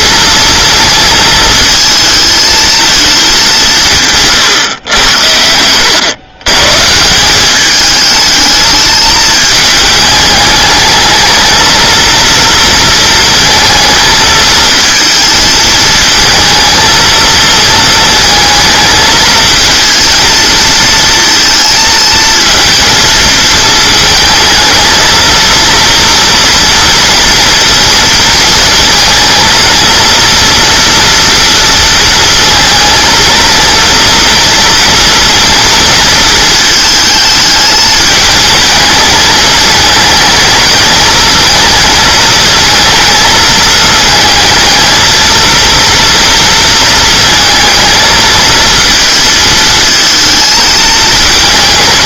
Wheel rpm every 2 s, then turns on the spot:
230, 220, 110, 150, 210, 210, 230, 220, 220, 220, 230, 230, 220, 230, 220, 230, 230, 230, 220, 220, 220, 220, 220, 230, 220, 220.
none